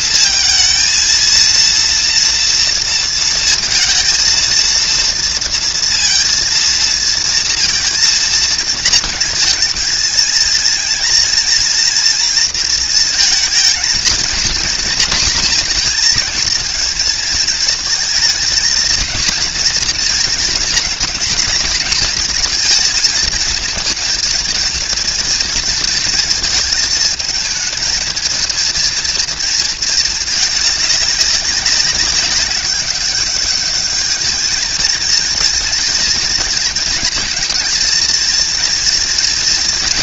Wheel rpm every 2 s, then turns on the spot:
230, 230, 230, 230, 230, 230, 230, 240, 220, 230, 230, 220, 230, 220, 220, 210, 200, 220, 230, 230.
none